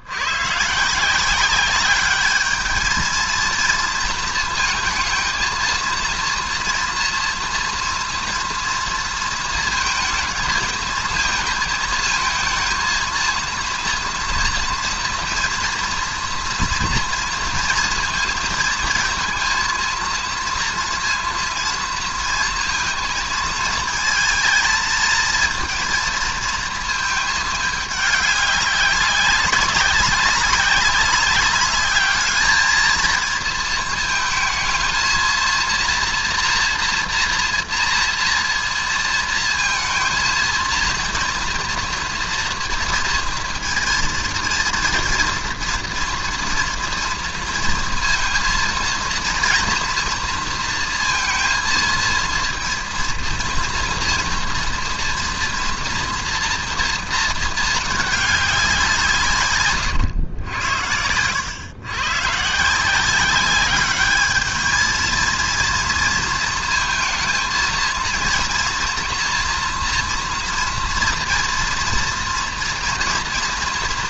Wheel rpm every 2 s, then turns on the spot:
140, 210, 230, 230, 230, 220, 220, 230, 230, 220, 230, 230, 230, 230, 200, 200, 220, 230, 240, 230, 230, 230, 230, 230, 220, 230, 230, 230, 230, 190, 90, 140, 210, 230, 230, 240, 230.
none